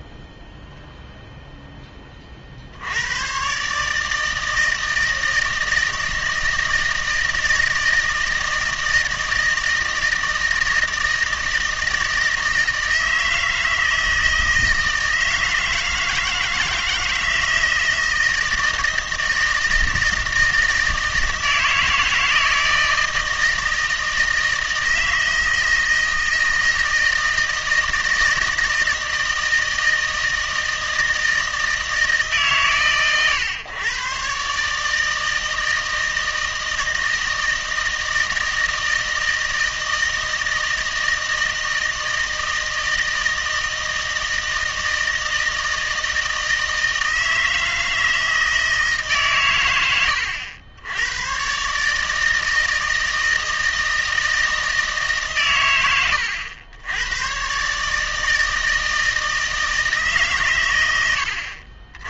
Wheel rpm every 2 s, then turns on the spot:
0, 70, 160, 160, 160, 160, 160, 160, 160, 160, 160, 160, 160, 160, 160, 160, 140, 150, 160, 160, 160, 160, 170, 160, 160, 90, 160, 160, 90, 160, 110.
none